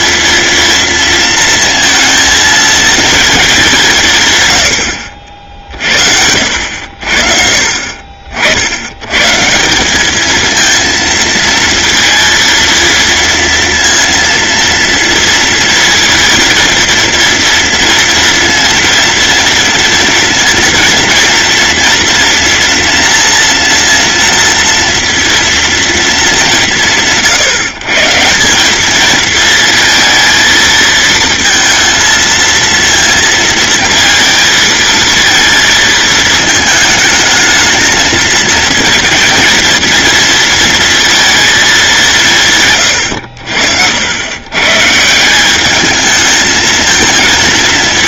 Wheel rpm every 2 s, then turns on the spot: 230, 230, 90, 60, 90, 230, 230, 230, 230, 230, 230, 230, 230, 160, 200, 220, 230, 230, 220, 220, 230, 130, 150, 220.
none